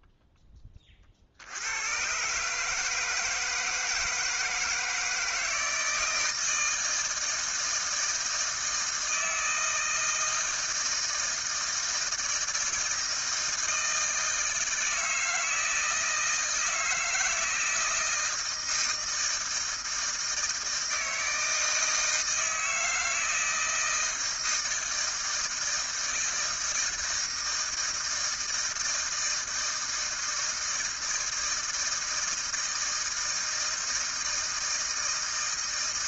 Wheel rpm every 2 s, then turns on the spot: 10, 140, 160, 160, 160, 160, 160, 160, 160, 160, 160, 160, 160, 160, 160, 160, 160, 160.
none